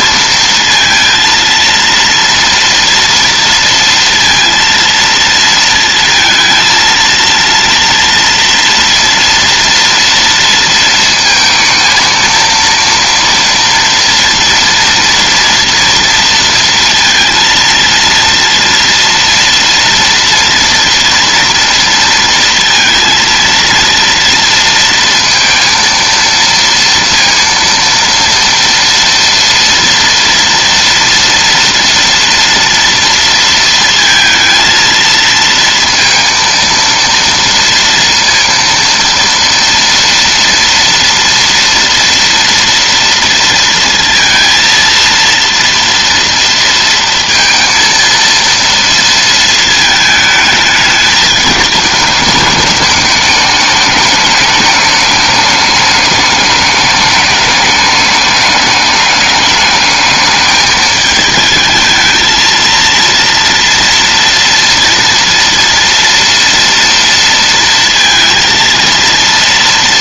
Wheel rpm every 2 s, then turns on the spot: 230, 230, 230, 230, 230, 230, 230, 230, 230, 230, 230, 230, 230, 230, 230, 230, 240, 230, 230, 230, 230, 230, 230, 230, 230, 210, 210, 210, 210, 200, 210, 230, 230, 230, 230.
none